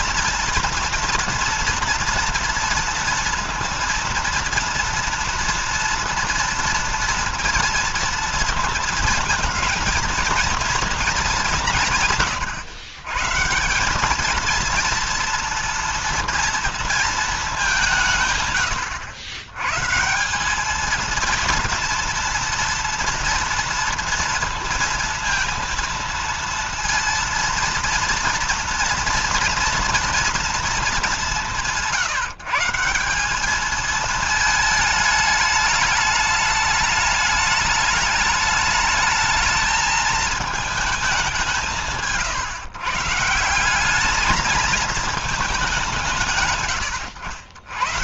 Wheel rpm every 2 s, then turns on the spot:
230, 230, 230, 230, 230, 230, 120, 230, 230, 120, 200, 230, 230, 230, 230, 220, 170, 220, 210, 210, 220, 140, 220, 140.
none